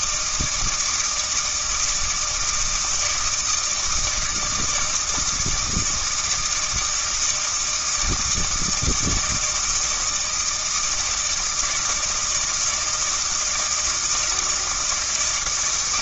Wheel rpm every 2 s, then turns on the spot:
160, 160, 160, 160, 160, 160, 160, 170.
none